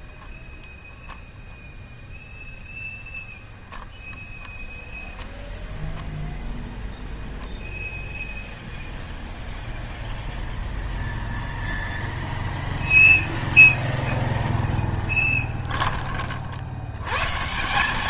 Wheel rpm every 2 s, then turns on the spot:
0, 0, 0, 10, 0, 0, 0, 0, 50.
none